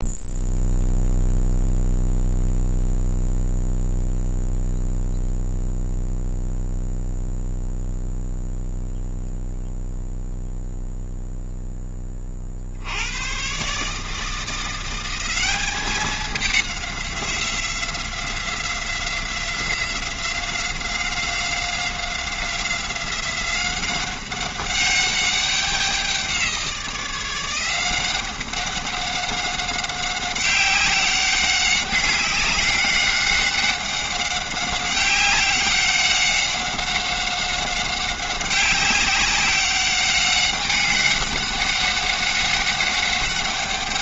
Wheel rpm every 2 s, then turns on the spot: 0, 0, 0, 0, 0, 0, 30, 160, 200, 180, 180, 180, 190, 180, 190, 190, 190, 190, 190, 190, 190, 190.
none